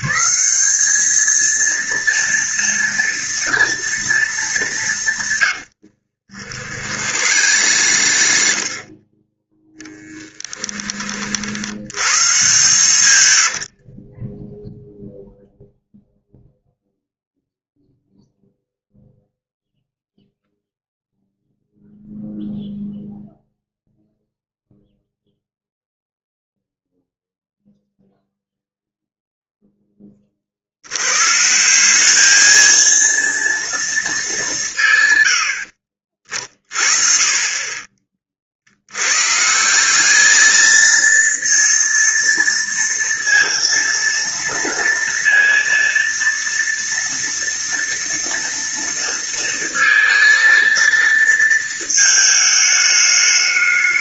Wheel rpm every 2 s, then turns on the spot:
220, 230, 160, 60, 30, 20, 140, 0, 0, 0, 0, 0, 0, 0, 0, 90, 230, 140, 30, 90, 230, 230, 230, 230, 230, 230, 210.
6-8